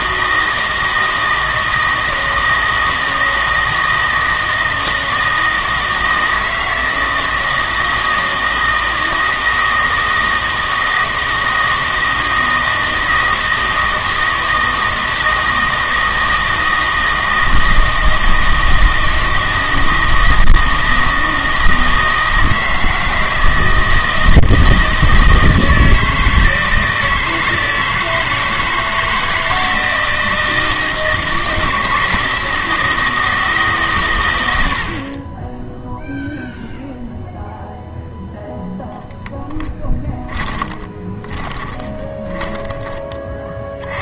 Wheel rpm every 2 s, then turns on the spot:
160, 160, 160, 160, 160, 160, 160, 160, 160, 160, 160, 160, 160, 160, 160, 160, 160, 60, 0, 0, 20, 20.
34-36 40-42